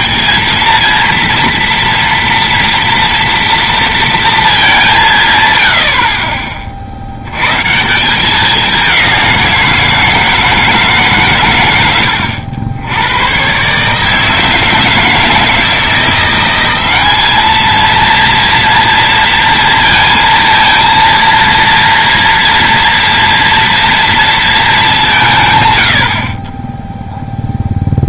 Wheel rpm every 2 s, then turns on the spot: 220, 230, 210, 30, 200, 160, 90, 160, 190, 230, 230, 240, 210, 20.
none